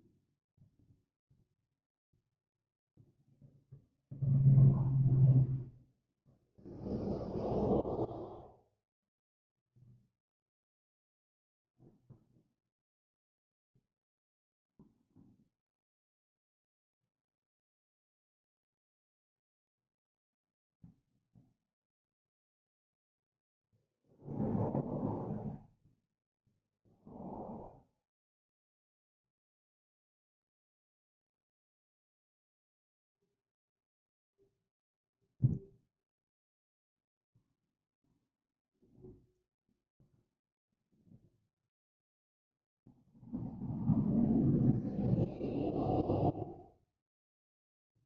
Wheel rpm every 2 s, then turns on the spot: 0, 0, 0, 0, 0, 0, 0, 0, 0, 0, 0, 0, 0, 0, 0, 0, 0, 0, 0, 0, 0, 0, 0, 0.
none